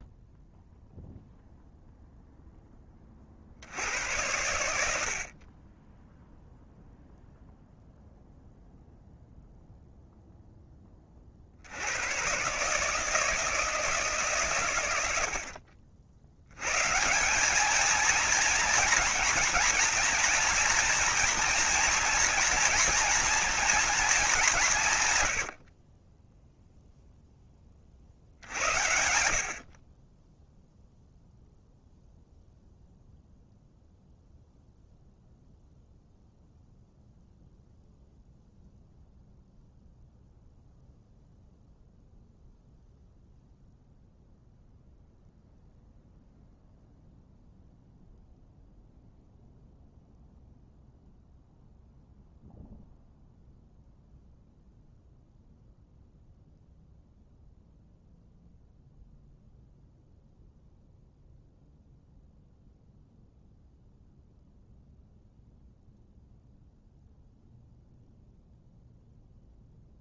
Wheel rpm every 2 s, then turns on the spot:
0, 20, 70, 0, 0, 20, 150, 80, 140, 230, 230, 230, 150, 0, 70, 0, 0, 0, 0, 0, 0, 0, 0, 0, 0, 0, 0, 0, 0, 0, 0, 0, 0, 0, 0.
none